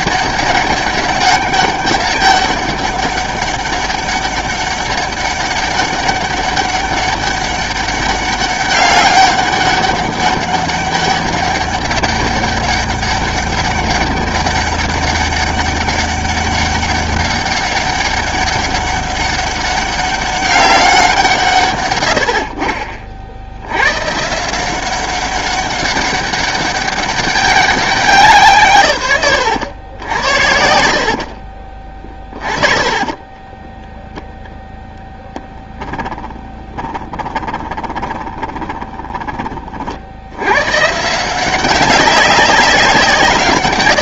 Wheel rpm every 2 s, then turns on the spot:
200, 200, 200, 200, 200, 200, 200, 200, 200, 200, 200, 60, 170, 200, 150, 70, 30, 0, 20, 20, 110, 190.
32-34 36-40